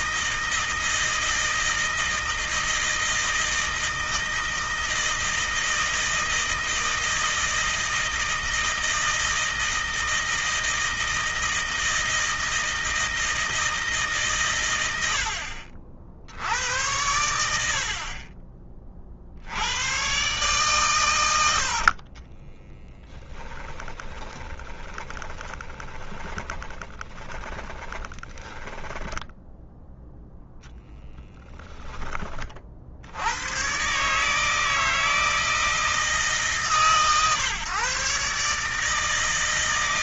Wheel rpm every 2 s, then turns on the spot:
160, 160, 160, 160, 160, 160, 160, 90, 90, 40, 120, 10, 30, 20, 10, 0, 70, 160, 140, 150.
22-30